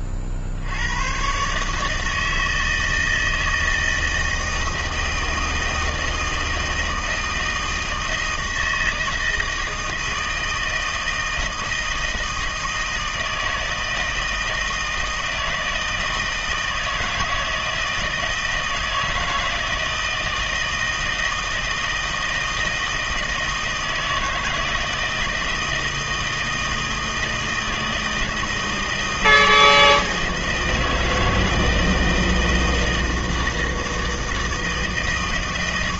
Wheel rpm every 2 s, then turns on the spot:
80, 160, 160, 160, 160, 160, 160, 160, 160, 160, 160, 160, 160, 160, 160, 160, 160, 160.
none